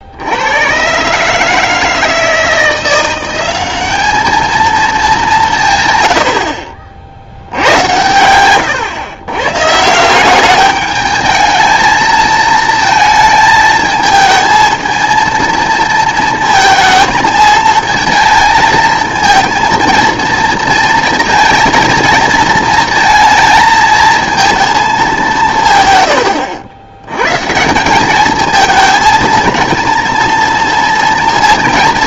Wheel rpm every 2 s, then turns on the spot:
120, 170, 220, 50, 100, 210, 230, 220, 230, 220, 230, 230, 220, 100, 220, 230.
none